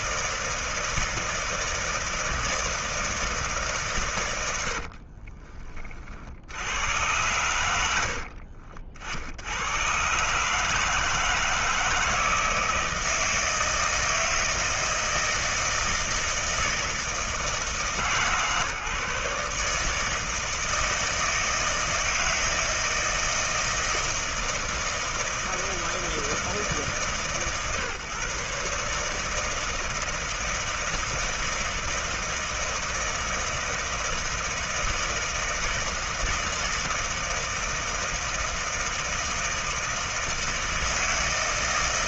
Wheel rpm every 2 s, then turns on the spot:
160, 160, 60, 100, 60, 160, 160, 160, 160, 150, 160, 160, 160, 150, 150, 160, 160, 160, 160, 160, 160.
4-6